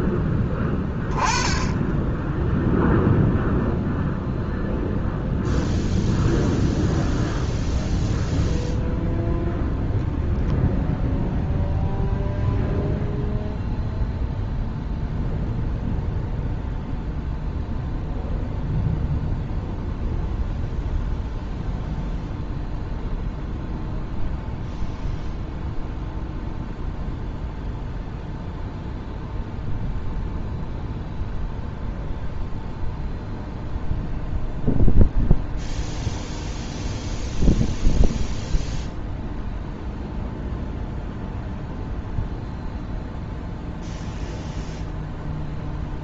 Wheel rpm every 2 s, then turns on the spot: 10, 0, 0, 0, 0, 0, 0, 0, 0, 0, 0, 0, 0, 0, 0, 0, 0, 0, 0, 0, 0, 0, 0.
none